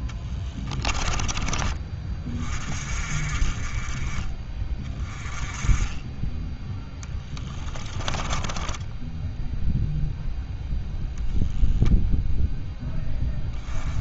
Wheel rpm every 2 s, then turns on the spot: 20, 40, 20, 10, 10, 0, 0.
0-2 8-10